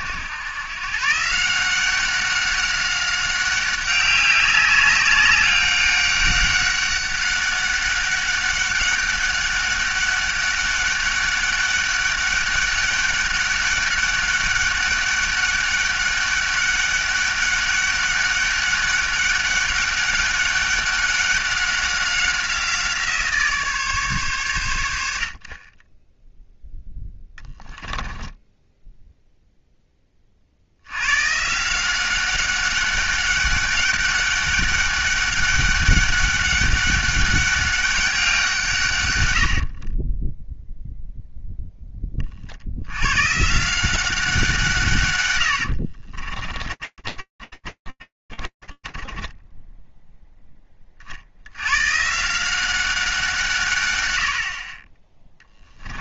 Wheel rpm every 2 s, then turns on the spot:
120, 190, 200, 200, 200, 200, 200, 200, 200, 200, 200, 180, 120, 0, 10, 60, 190, 200, 200, 170, 10, 40, 180, 30, 10, 160, 50, 30.
28-30 46-48 54-56